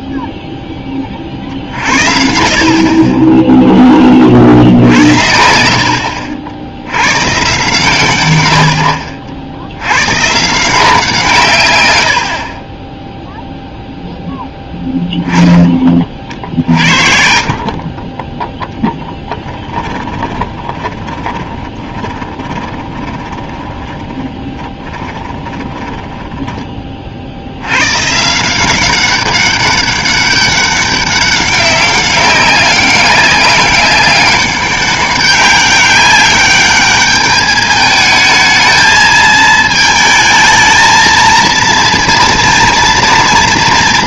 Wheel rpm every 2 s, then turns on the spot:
10, 50, 60, 80, 70, 160, 20, 10, 50, 0, 20, 20, 20, 30, 180, 200, 190, 200, 210, 220, 220, 230.
14-18 20-26